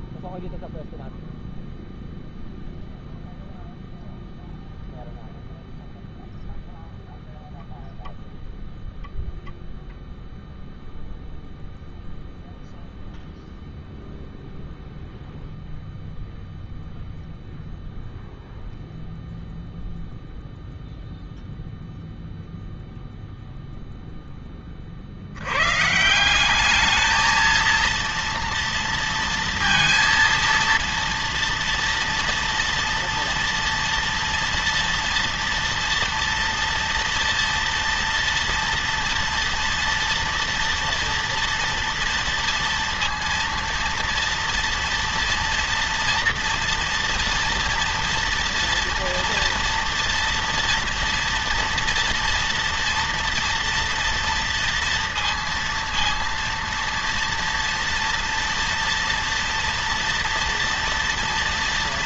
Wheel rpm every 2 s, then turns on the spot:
0, 0, 0, 0, 0, 0, 0, 0, 0, 0, 0, 0, 20, 180, 230, 230, 230, 230, 230, 230, 240, 230, 230, 230, 230, 230, 230, 230, 230, 230, 240.
none